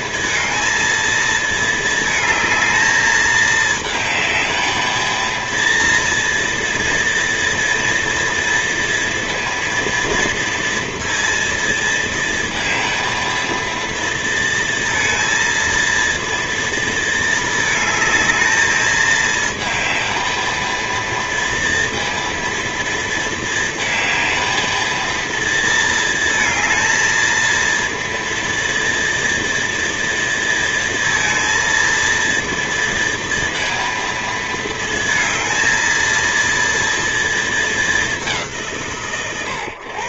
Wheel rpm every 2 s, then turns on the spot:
220, 220, 220, 230, 230, 230, 230, 230, 230, 220, 230, 230, 220, 230, 230, 230, 230, 220, 230, 150.
none